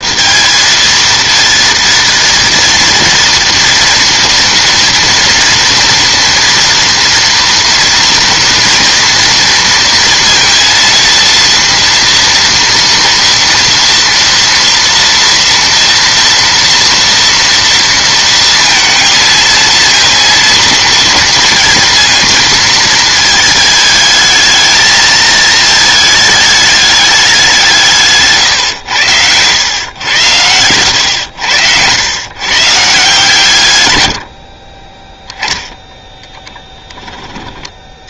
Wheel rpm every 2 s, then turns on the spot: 230, 230, 230, 230, 230, 230, 230, 230, 230, 230, 230, 230, 220, 210, 120, 100, 140, 30, 10.
none